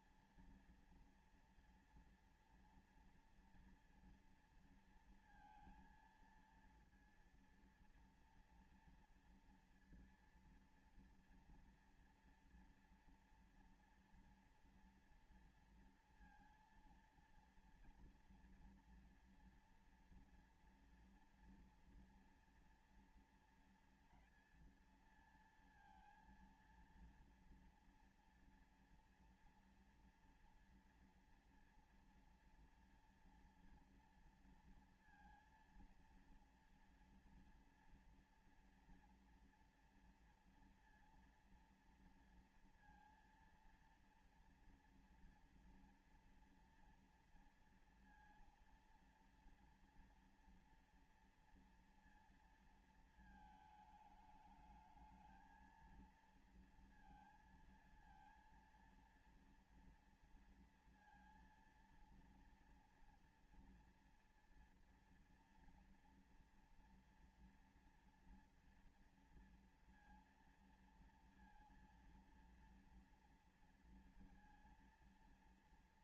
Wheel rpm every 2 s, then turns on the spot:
230, 240, 230, 230, 230, 230, 230, 230, 230, 240, 230, 230, 230, 230, 230, 230, 230, 230, 230, 240, 230, 230, 240, 240, 230, 230, 230, 220, 230, 230, 230, 230, 230, 230, 240, 240, 230, 230.
none